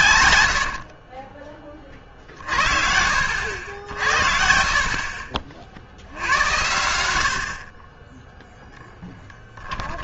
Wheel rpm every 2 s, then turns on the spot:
90, 60, 50, 80, 0.
none